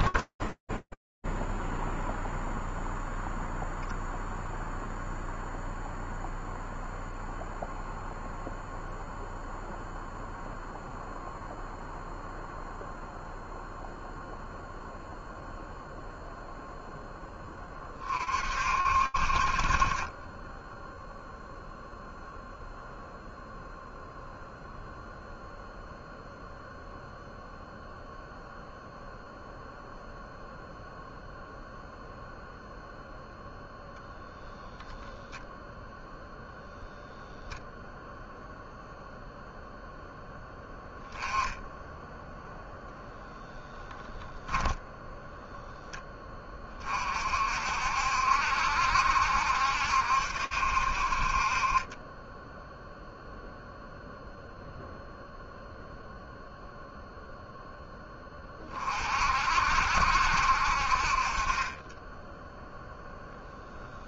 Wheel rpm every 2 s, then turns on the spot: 10, 0, 0, 0, 0, 0, 0, 0, 20, 40, 0, 0, 0, 0, 0, 0, 0, 0, 0, 0, 10, 10, 0, 50, 70, 30, 0, 0, 0, 60, 30, 0.
0-2